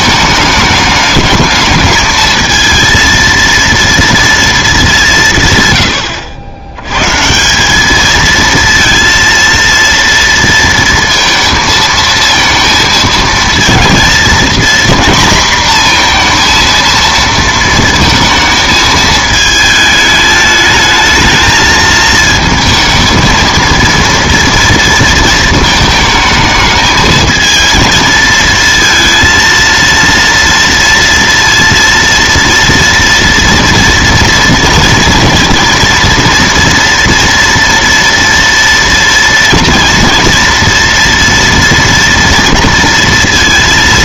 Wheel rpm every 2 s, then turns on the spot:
220, 220, 210, 100, 230, 230, 220, 240, 230, 220, 220, 220, 230, 220, 230, 230, 230, 230, 240, 230, 230, 230.
none